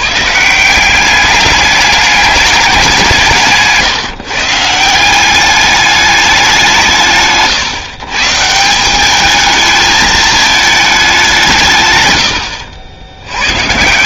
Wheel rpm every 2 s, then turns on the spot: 170, 200, 160, 180, 170, 220, 90.
12-14